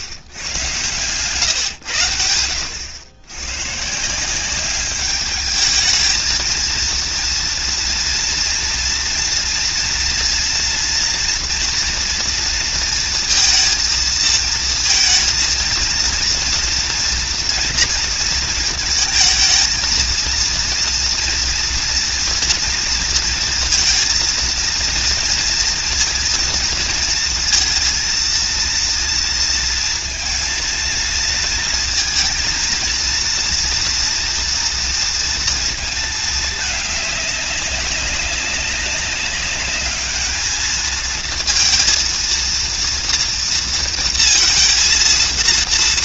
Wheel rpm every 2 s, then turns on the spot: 120, 100, 200, 230, 230, 230, 230, 230, 240, 230, 230, 230, 230, 230, 230, 230, 230, 230, 210, 200, 220, 230, 230.
none